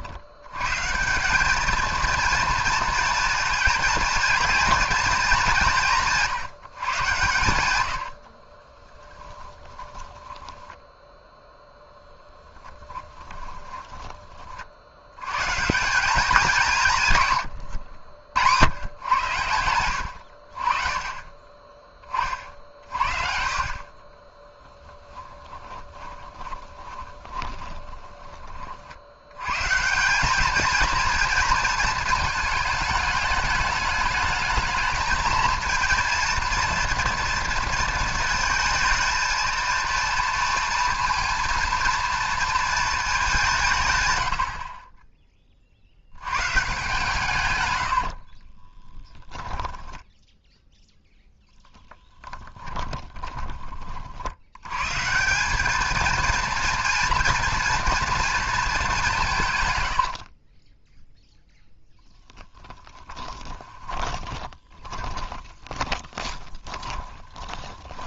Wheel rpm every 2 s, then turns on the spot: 140, 230, 230, 140, 30, 10, 10, 50, 170, 110, 50, 50, 10, 20, 40, 220, 220, 220, 230, 220, 230, 220, 40, 130, 20, 0, 10, 110, 230, 210, 10, 10, 20, 20.
8-14 24-28 48-50 52-54 60-68